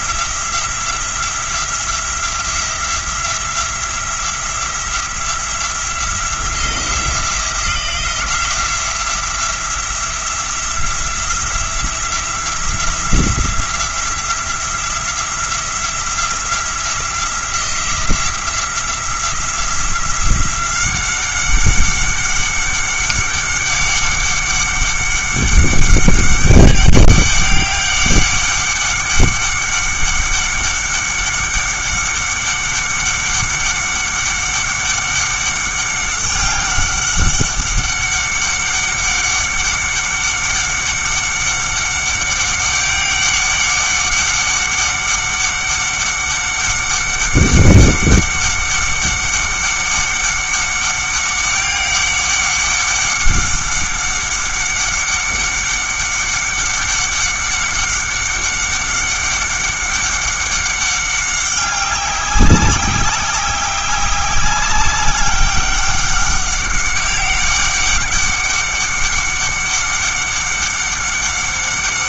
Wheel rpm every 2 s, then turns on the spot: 170, 170, 170, 170, 180, 170, 170, 170, 170, 170, 190, 200, 200, 200, 200, 200, 200, 200, 190, 190, 190, 200, 190, 200, 200, 200, 200, 200, 200, 200, 200, 190, 190, 200, 200, 200.
none